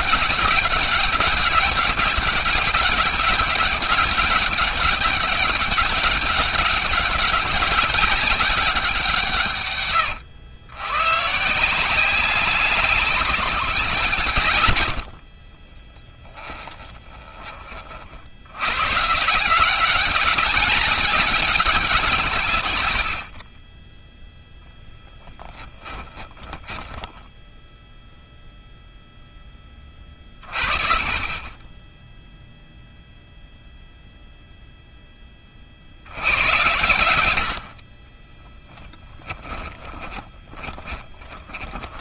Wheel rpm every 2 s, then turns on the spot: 200, 200, 200, 200, 150, 140, 190, 70, 20, 140, 200, 100, 10, 10, 0, 20, 0, 10, 90, 10, 10.
14-16 26-28 38-42